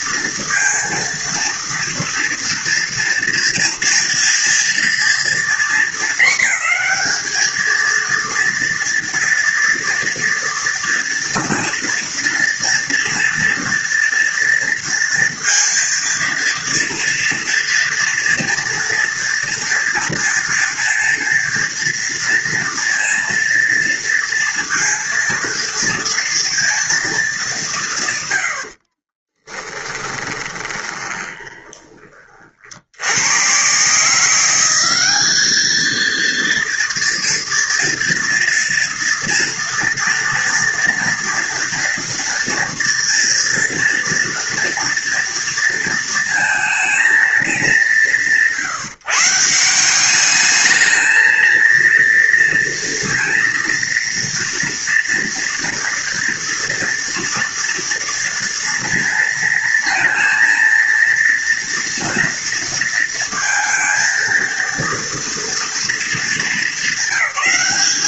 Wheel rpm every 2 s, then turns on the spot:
230, 230, 230, 220, 230, 230, 230, 230, 230, 230, 230, 230, 230, 230, 80, 20, 50, 180, 230, 230, 230, 230, 230, 220, 170, 210, 230, 230, 240, 230, 230, 230, 230, 210.
30-32